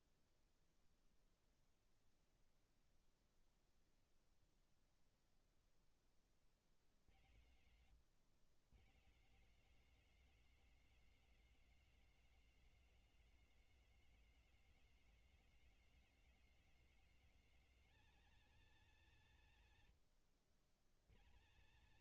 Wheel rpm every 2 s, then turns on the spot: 0, 0, 0, 40, 110, 190, 180, 180, 180, 220, 80.
none